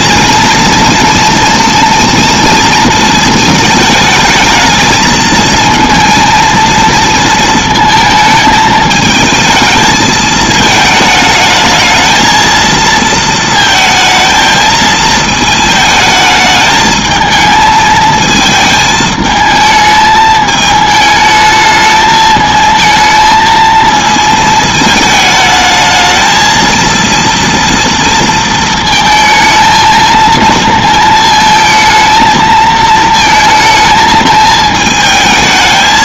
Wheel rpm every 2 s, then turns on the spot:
230, 230, 220, 230, 220, 220, 220, 220, 220, 220, 220, 220, 220, 220, 230, 230, 220, 220.
none